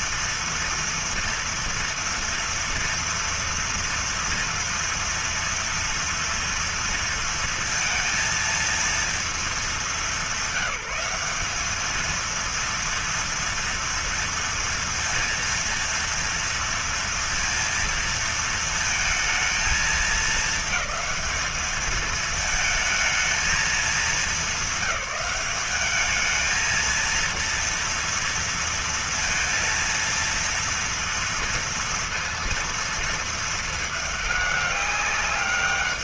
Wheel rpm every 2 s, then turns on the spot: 230, 230, 230, 230, 230, 190, 230, 230, 230, 230, 220, 220, 200, 220, 230, 230, 230, 210.
none